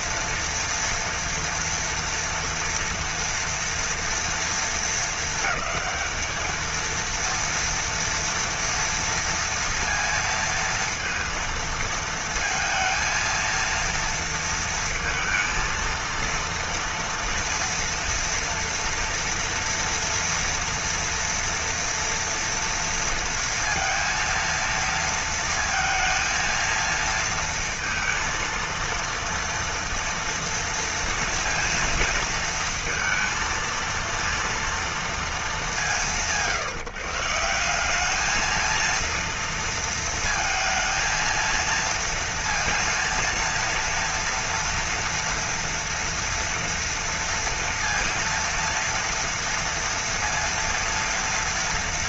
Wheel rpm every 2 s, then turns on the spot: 230, 230, 230, 220, 230, 230, 220, 230, 230, 230, 240, 230, 230, 230, 230, 230, 230, 230, 160, 210, 230, 230, 230, 230, 230, 230.
none